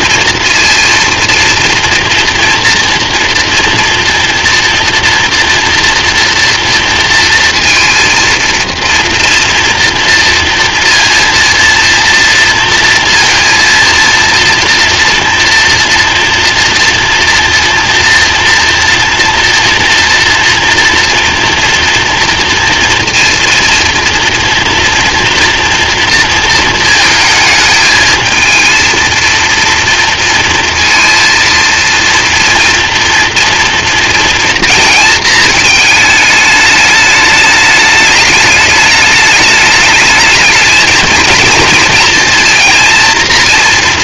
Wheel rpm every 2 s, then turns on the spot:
230, 230, 230, 230, 230, 230, 230, 230, 230, 230, 230, 230, 230, 230, 220, 230, 230, 230, 210, 210, 220, 230.
none